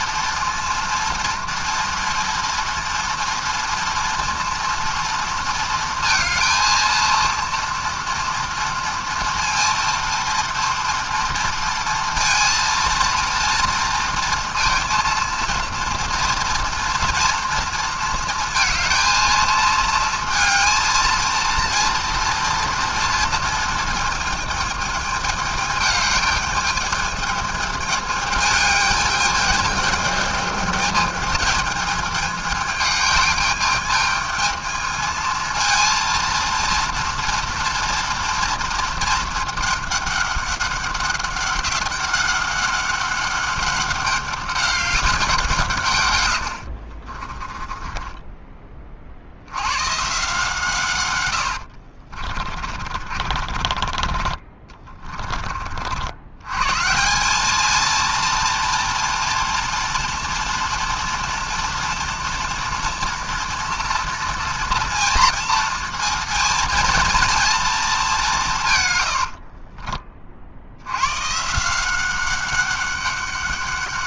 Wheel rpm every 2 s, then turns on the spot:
230, 230, 230, 230, 230, 230, 230, 230, 230, 230, 230, 230, 220, 210, 210, 210, 210, 220, 230, 230, 200, 200, 200, 100, 30, 140, 30, 30, 120, 230, 240, 240, 230, 230, 170, 60, 190.
46-48 52-56